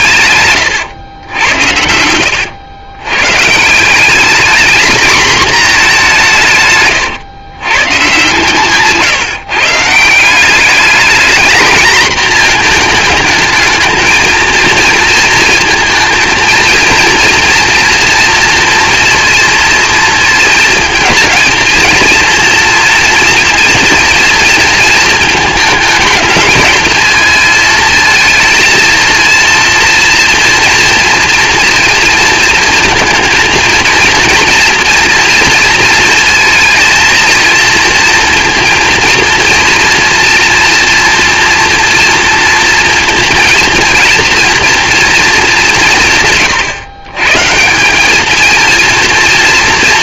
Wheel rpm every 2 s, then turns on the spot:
120, 90, 220, 170, 140, 190, 230, 230, 230, 230, 230, 230, 230, 220, 230, 230, 230, 230, 230, 230, 230, 230, 240, 130, 220.
none